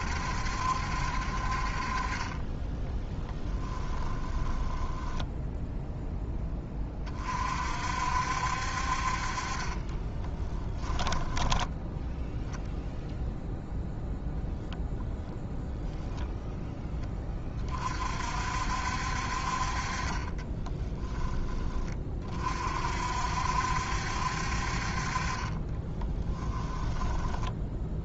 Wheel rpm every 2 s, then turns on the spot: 60, 10, 10, 30, 50, 20, 0, 0, 10, 60, 30, 60, 40, 10.
2-6 10-12